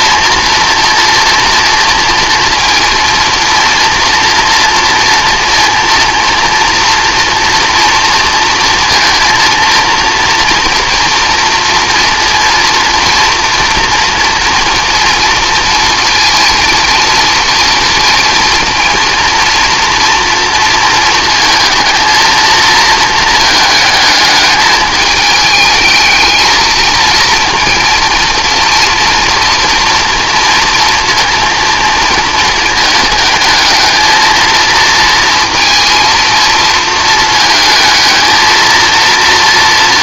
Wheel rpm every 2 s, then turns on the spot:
240, 230, 240, 240, 230, 230, 230, 240, 230, 230, 230, 220, 210, 230, 230, 230, 220, 230, 230, 230.
none